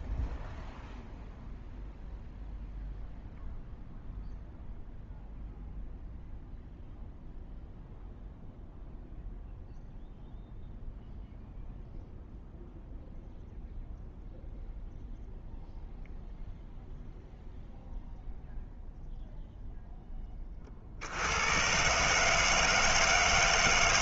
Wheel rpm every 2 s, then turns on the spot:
0, 0, 0, 0, 0, 0, 0, 0, 0, 0, 20, 150.
none